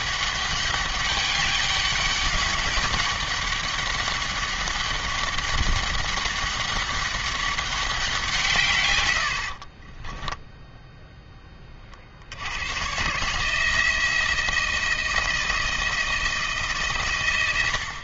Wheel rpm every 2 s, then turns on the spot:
200, 200, 200, 200, 140, 0, 120, 170, 150.
none